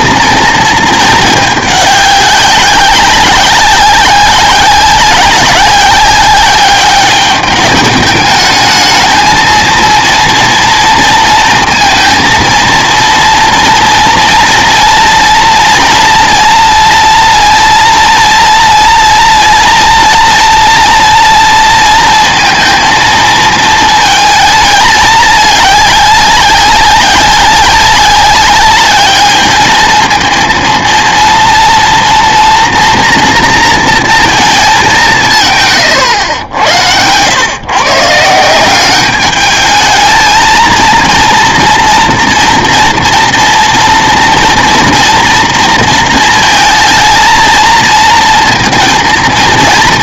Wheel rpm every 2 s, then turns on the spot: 230, 190, 190, 200, 210, 230, 230, 230, 230, 230, 230, 230, 220, 200, 200, 230, 230, 210, 90, 180, 230, 230, 230, 220, 230.
none